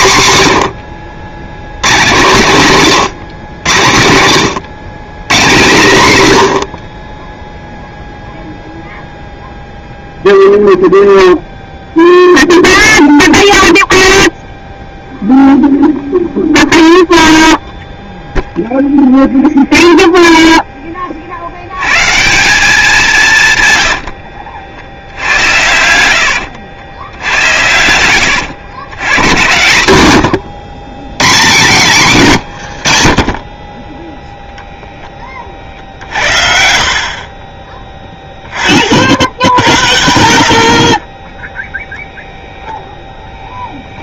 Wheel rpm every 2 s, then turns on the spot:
90, 170, 120, 60, 0, 0, 0, 0, 0, 0, 10, 180, 60, 80, 100, 110, 90, 0, 50, 40, 40, 0.
32-34